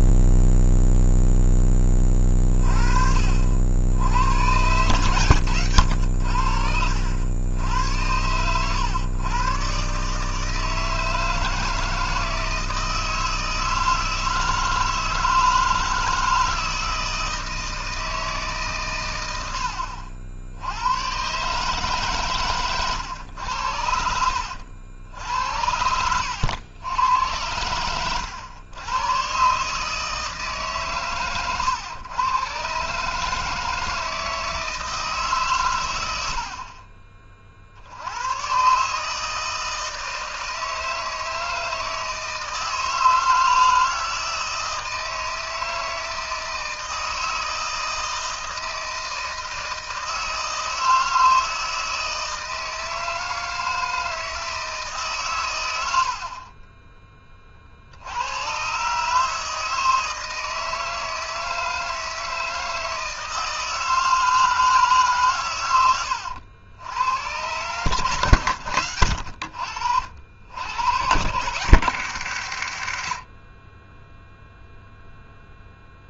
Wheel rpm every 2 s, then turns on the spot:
0, 40, 130, 80, 110, 160, 160, 160, 160, 130, 100, 110, 70, 100, 110, 140, 140, 160, 40, 140, 160, 160, 160, 160, 160, 160, 160, 150, 10, 130, 160, 160, 150, 90, 100, 100, 110, 0.
none